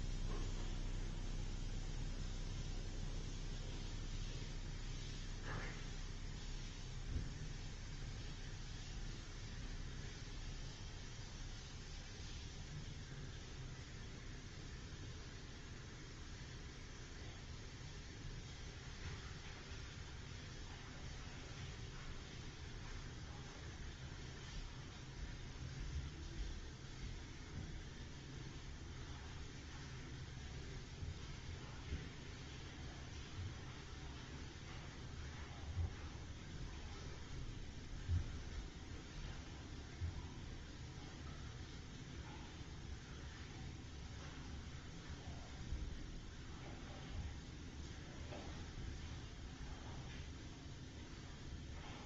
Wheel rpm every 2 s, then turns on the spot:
0, 0, 0, 0, 0, 0, 0, 0, 0, 0, 0, 0, 0, 0, 0, 0, 0, 0, 0, 0, 0, 0, 0, 0, 0, 0.
none